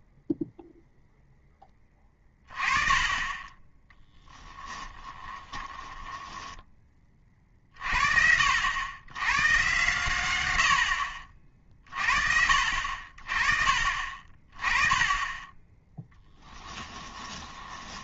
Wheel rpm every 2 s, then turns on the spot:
0, 30, 20, 20, 90, 90, 50, 20, 10.
4-6 16-18